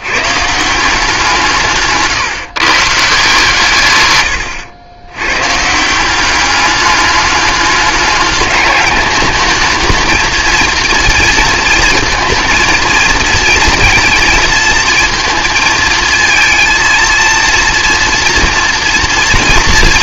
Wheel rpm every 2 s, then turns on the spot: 160, 140, 90, 200, 210, 230, 230, 230, 230, 230.
none